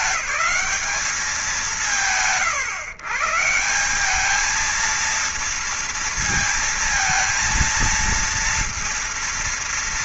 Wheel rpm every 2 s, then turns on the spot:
200, 140, 200, 230, 230.
none